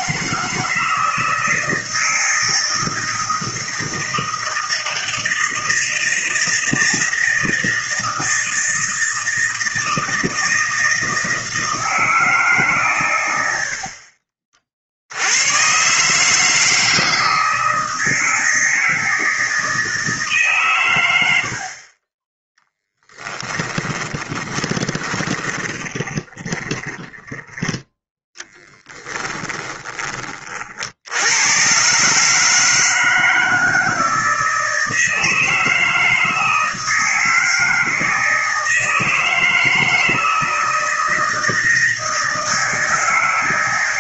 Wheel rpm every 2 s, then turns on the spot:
160, 160, 160, 160, 160, 160, 130, 60, 160, 160, 120, 10, 20, 20, 10, 60, 160, 160, 160, 160, 160, 160.
24-30